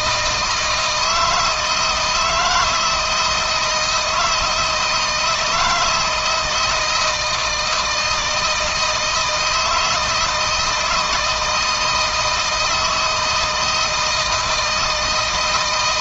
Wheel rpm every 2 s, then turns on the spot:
160, 160, 170, 160, 160, 160, 160, 160.
none